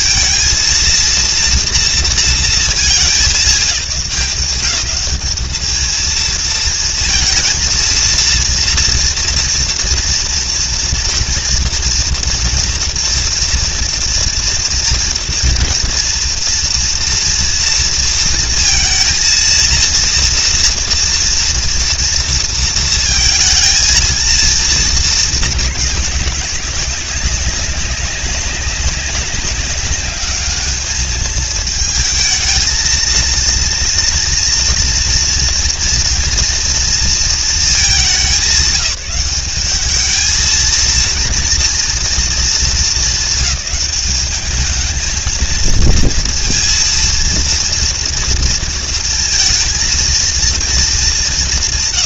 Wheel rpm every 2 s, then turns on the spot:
230, 210, 200, 230, 230, 240, 230, 230, 230, 230, 230, 230, 230, 200, 200, 210, 220, 230, 230, 180, 220, 220, 220, 230, 230, 230.
none